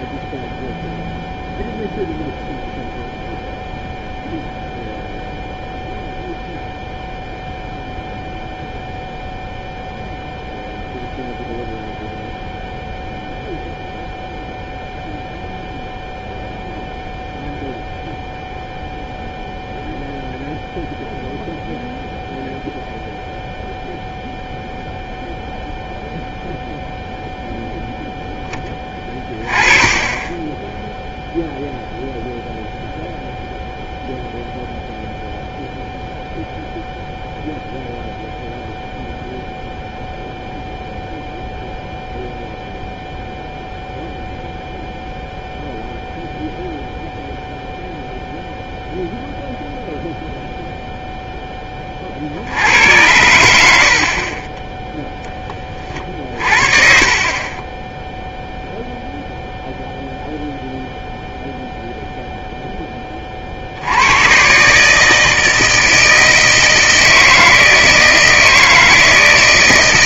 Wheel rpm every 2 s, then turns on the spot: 0, 0, 0, 0, 0, 0, 0, 0, 0, 0, 0, 0, 0, 0, 20, 10, 0, 0, 0, 0, 0, 0, 0, 0, 0, 0, 80, 10, 40, 0, 0, 10, 140, 160, 160.
none